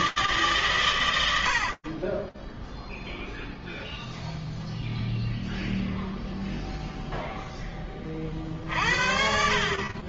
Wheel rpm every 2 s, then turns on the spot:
20, 0, 0, 40, 10.
none